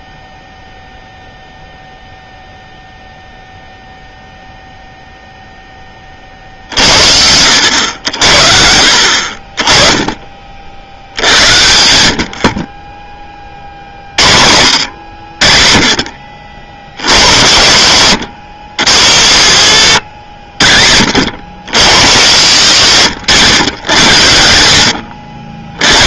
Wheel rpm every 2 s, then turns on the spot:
0, 0, 0, 50, 60, 60, 30, 90, 60, 110, 80, 120, 90.
20-22